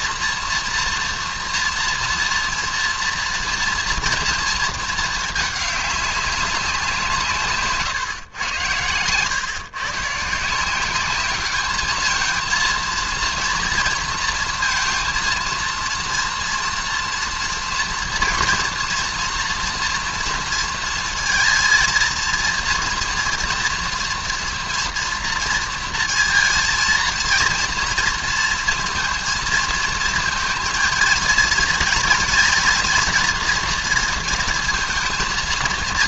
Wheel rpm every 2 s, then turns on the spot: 240, 230, 220, 180, 100, 180, 230, 230, 230, 230, 230, 230, 230, 230, 230, 230, 240, 220.
none